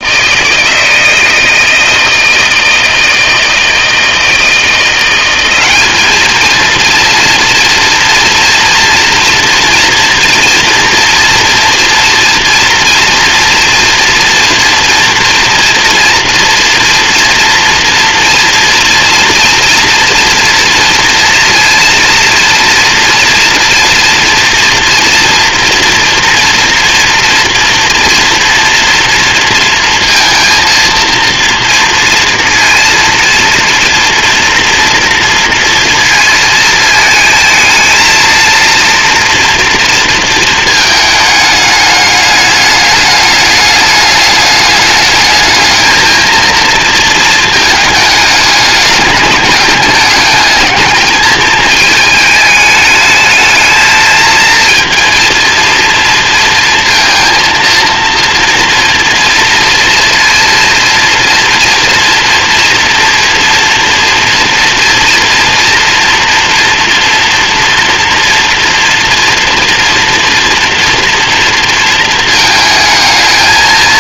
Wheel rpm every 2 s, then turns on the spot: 160, 160, 170, 230, 240, 230, 230, 230, 230, 230, 230, 230, 230, 230, 230, 230, 230, 230, 230, 230, 220, 210, 210, 230, 210, 220, 210, 230, 220, 230, 230, 230, 230, 230, 240, 230, 220.
none